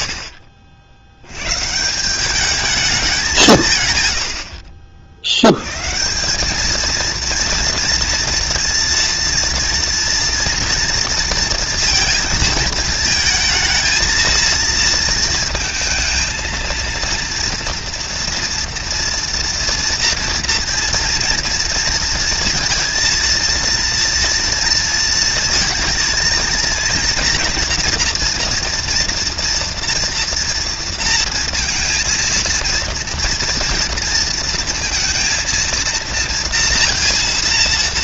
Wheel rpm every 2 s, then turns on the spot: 70, 200, 70, 230, 230, 230, 220, 230, 230, 230, 230, 230, 230, 230, 240, 230, 230, 230, 230.
none